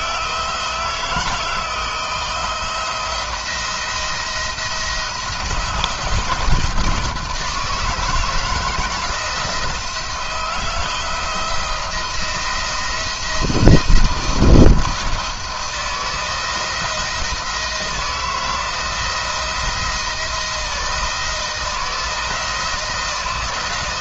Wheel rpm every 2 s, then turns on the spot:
160, 160, 160, 170, 160, 170, 170, 170, 160, 170, 160, 170.
none